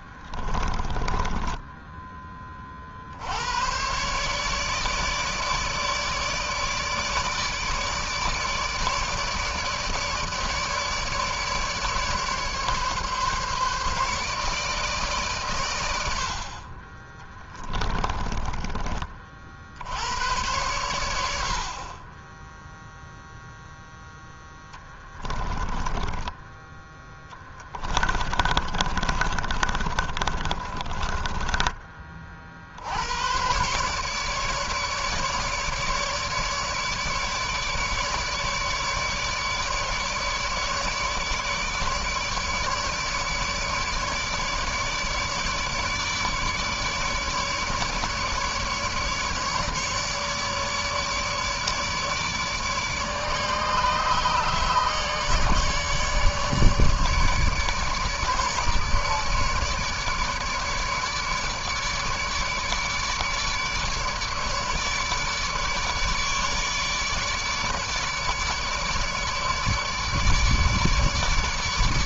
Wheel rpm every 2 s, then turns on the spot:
20, 60, 150, 150, 150, 150, 150, 150, 30, 40, 100, 0, 20, 10, 40, 20, 80, 150, 150, 150, 150, 150, 150, 150, 150, 150, 150, 150, 150, 150, 150, 150, 150, 150, 150, 150.
0-2 16-18 24-32